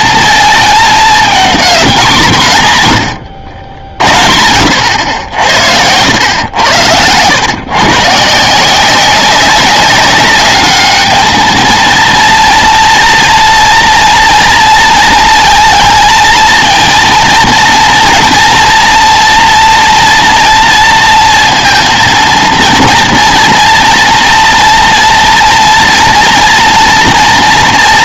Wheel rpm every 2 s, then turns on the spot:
220, 150, 80, 100, 170, 210, 230, 230, 230, 240, 230, 230, 230, 230.
6-8